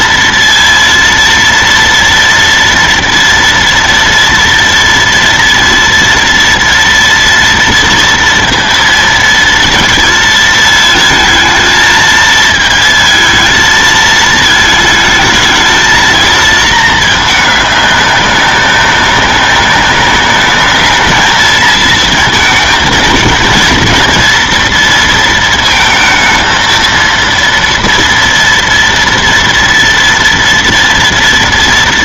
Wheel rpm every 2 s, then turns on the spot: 230, 230, 230, 230, 230, 220, 220, 220, 220, 200, 210, 230, 230, 230, 230, 230.
none